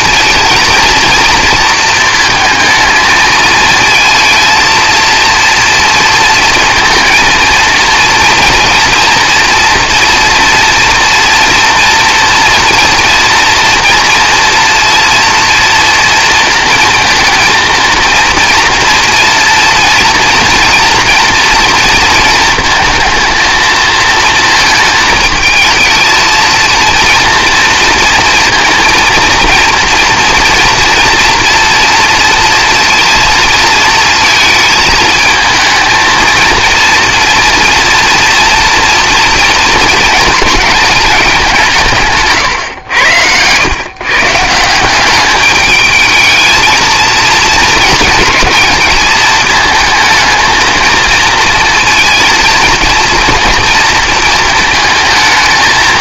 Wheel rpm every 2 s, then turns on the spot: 230, 220, 230, 230, 230, 230, 230, 240, 230, 240, 240, 230, 220, 230, 230, 230, 230, 220, 230, 230, 220, 130, 170, 220, 220, 220, 230, 230.
none